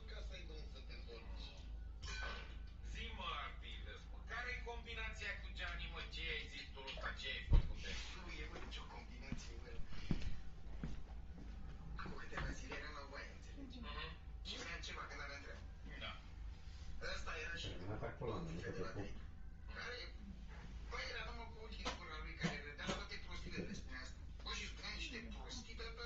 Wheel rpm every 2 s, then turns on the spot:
0, 0, 0, 0, 0, 0, 0, 0, 0, 0, 0, 0, 0.
none